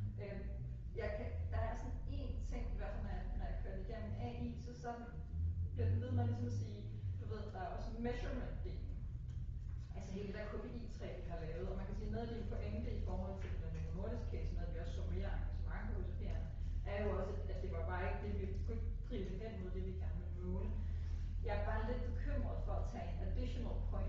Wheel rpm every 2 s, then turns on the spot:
0, 0, 0, 0, 0, 0, 0, 0, 0, 0, 0, 0.
none